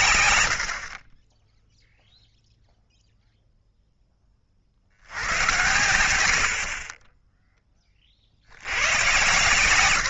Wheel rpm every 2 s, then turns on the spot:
60, 0, 60, 40, 90.
none